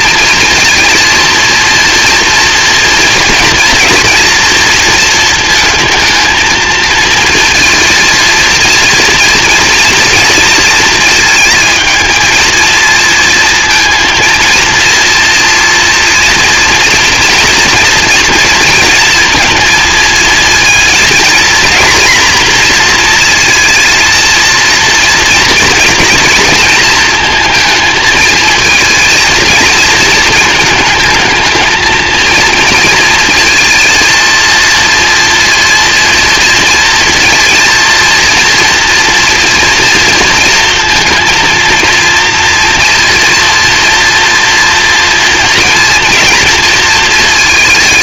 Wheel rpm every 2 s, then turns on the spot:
230, 230, 230, 230, 230, 230, 220, 230, 230, 230, 220, 240, 240, 230, 230, 220, 230, 230, 230, 230, 230, 230, 230, 230.
none